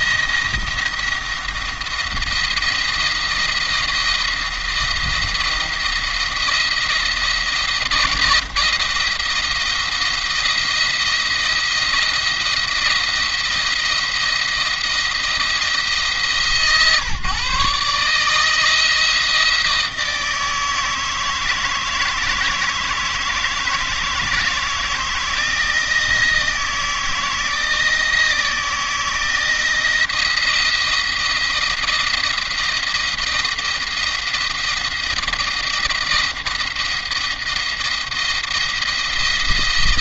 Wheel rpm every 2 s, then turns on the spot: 170, 170, 170, 170, 160, 170, 170, 170, 140, 160, 160, 160, 170, 160, 160, 170, 170, 170, 170, 170.
none